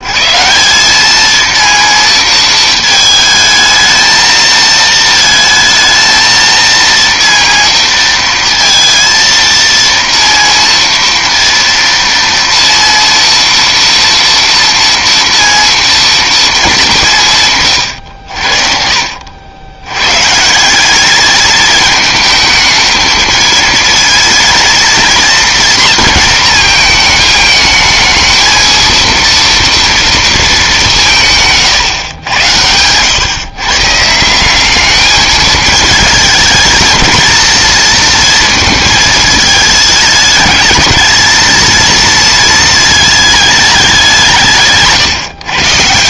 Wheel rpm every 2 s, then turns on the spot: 180, 220, 220, 230, 230, 230, 230, 230, 210, 60, 180, 220, 230, 220, 230, 210, 100, 190, 220, 230, 210, 220, 160.
none